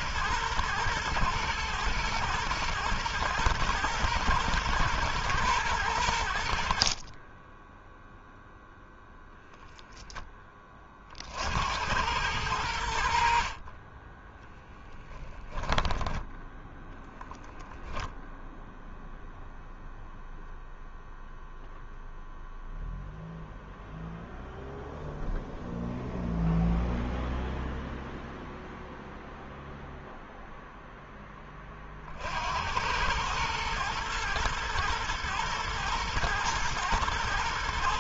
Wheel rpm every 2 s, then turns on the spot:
110, 120, 120, 50, 0, 40, 80, 10, 10, 0, 0, 0, 0, 0, 0, 0, 90, 110, 110.
12-14 16-18